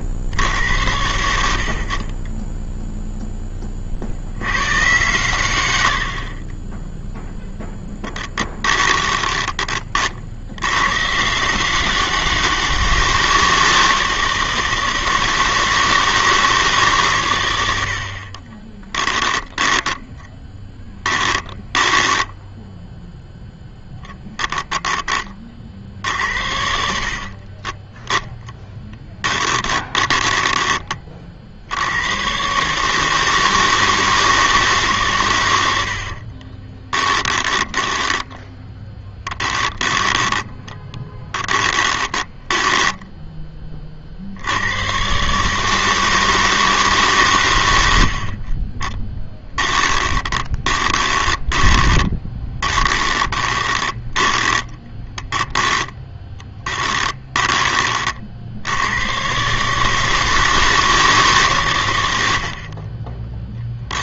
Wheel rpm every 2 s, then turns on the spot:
70, 30, 90, 30, 20, 90, 200, 170, 150, 30, 10, 0, 10, 60, 10, 20, 150, 140, 20, 10, 10, 10, 120, 150, 30, 20, 10, 10, 10, 100, 160, 30.
8-10 18-22 28-30 36-44 48-58